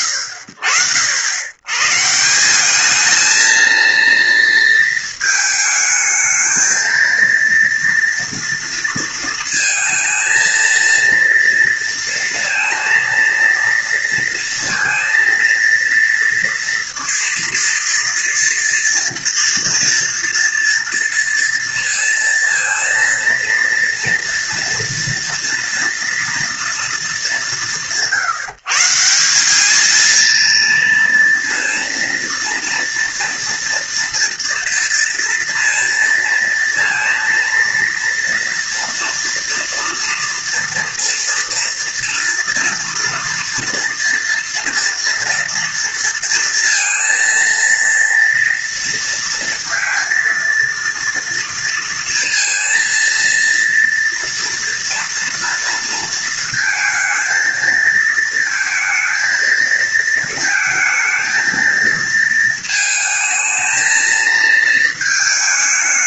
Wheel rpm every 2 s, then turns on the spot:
100, 230, 220, 230, 220, 230, 230, 240, 230, 230, 230, 230, 230, 150, 200, 230, 230, 230, 230, 230, 230, 240, 230, 230, 230, 230, 230, 230, 220, 230, 220, 220, 220.
none